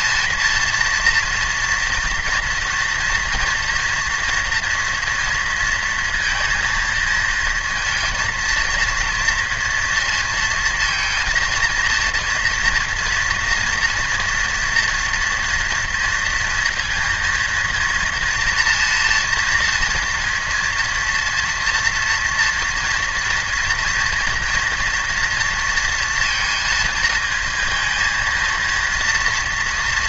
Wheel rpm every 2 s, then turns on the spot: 230, 230, 230, 230, 230, 220, 230, 230, 230, 230, 230, 230, 240, 230, 230.
none